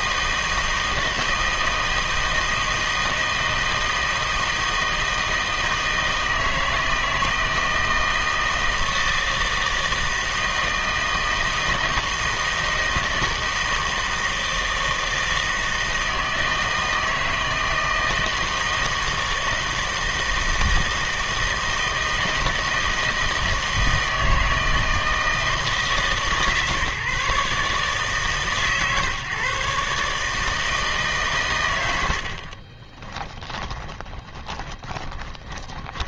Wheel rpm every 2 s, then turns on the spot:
160, 160, 160, 160, 160, 160, 160, 160, 160, 160, 160, 160, 160, 150, 140, 150, 40, 20.
32-36